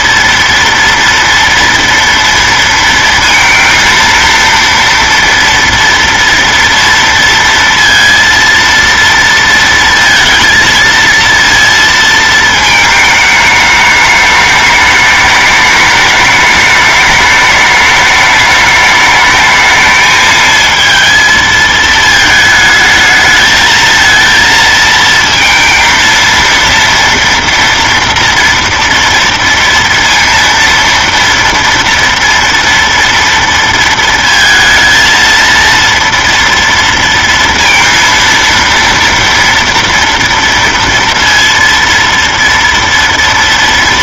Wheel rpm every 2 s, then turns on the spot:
230, 230, 230, 230, 230, 230, 220, 210, 210, 210, 220, 220, 230, 230, 230, 230, 230, 230, 230, 230, 230, 230.
none